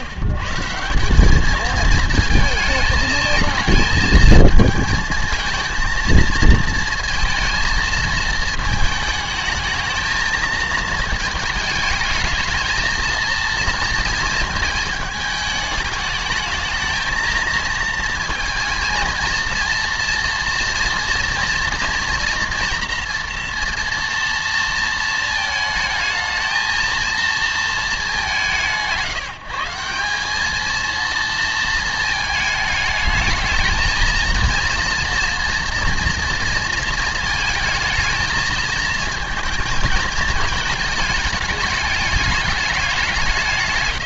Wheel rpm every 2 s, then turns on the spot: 140, 220, 220, 230, 220, 220, 220, 230, 220, 230, 230, 230, 230, 220, 180, 220, 220, 230, 230, 220, 220, 210.
none